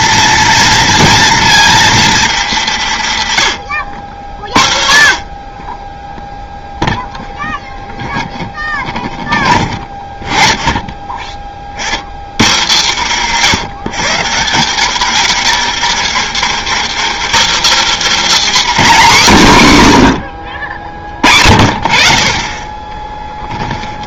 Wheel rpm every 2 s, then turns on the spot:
230, 190, 70, 0, 10, 10, 160, 190, 250, 300, 70, 20.
8-10